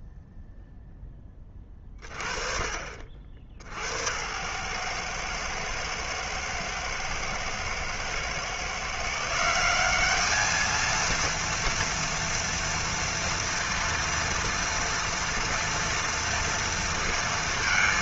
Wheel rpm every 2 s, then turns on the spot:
0, 50, 110, 110, 140, 220, 230, 230, 230.
none